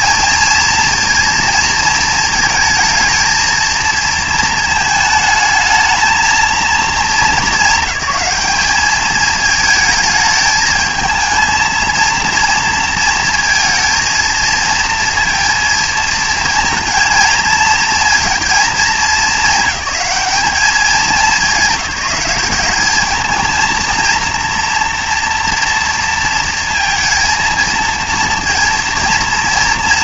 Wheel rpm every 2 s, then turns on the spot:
230, 220, 220, 230, 210, 220, 230, 230, 230, 220, 210, 210, 230, 230, 230.
none